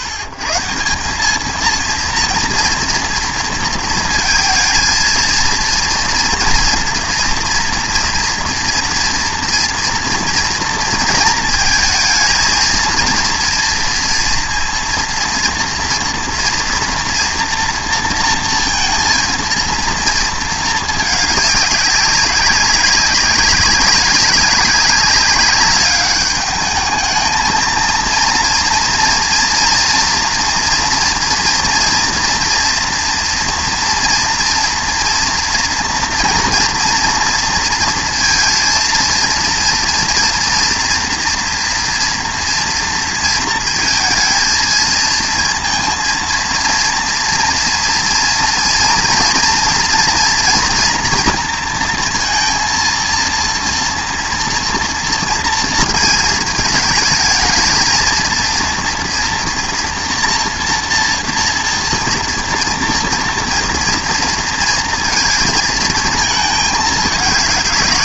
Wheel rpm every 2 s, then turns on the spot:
130, 230, 220, 230, 230, 230, 220, 230, 230, 230, 220, 200, 190, 210, 230, 230, 230, 230, 230, 230, 230, 230, 230, 230, 230, 230, 230, 230, 220, 230, 230, 230, 230, 220.
none